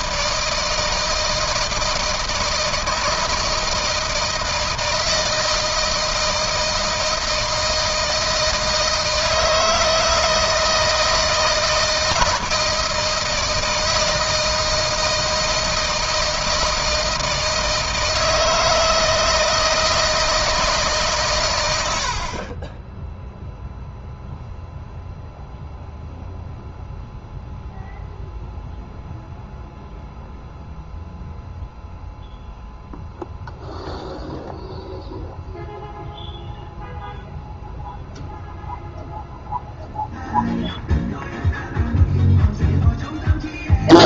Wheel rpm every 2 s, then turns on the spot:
160, 160, 160, 160, 160, 160, 160, 160, 160, 160, 150, 20, 0, 0, 0, 0, 0, 0, 0, 0, 0, 0.
none